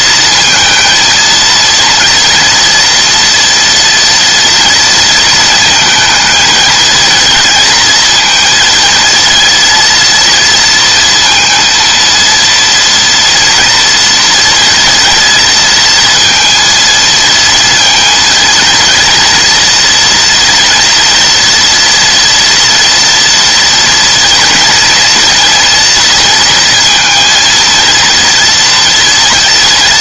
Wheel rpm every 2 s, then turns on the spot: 230, 230, 230, 230, 230, 230, 230, 230, 230, 230, 230, 230, 230, 230, 240.
none